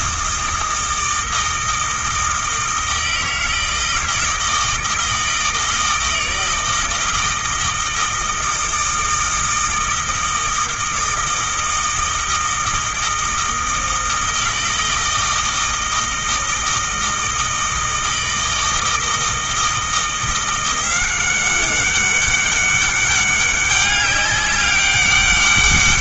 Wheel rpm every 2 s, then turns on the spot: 160, 160, 160, 160, 160, 160, 160, 160, 160, 160, 180, 200, 200.
none